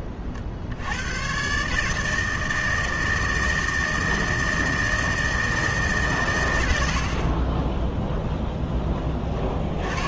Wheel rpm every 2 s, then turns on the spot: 80, 160, 160, 70, 20.
none